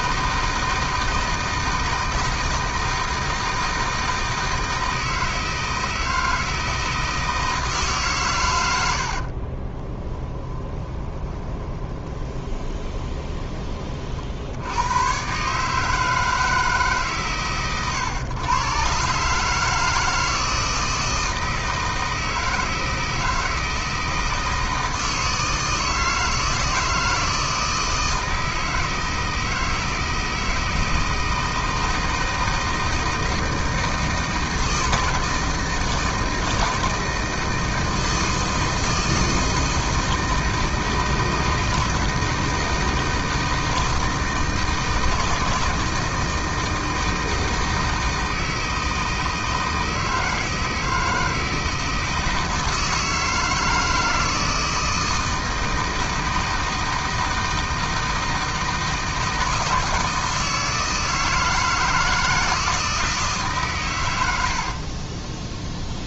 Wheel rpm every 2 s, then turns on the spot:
160, 160, 160, 160, 90, 20, 20, 100, 150, 120, 160, 160, 160, 160, 160, 160, 160, 160, 160, 160, 160, 160, 160, 160, 160, 160, 160, 160, 160, 160, 160, 160, 50.
10-14 64-66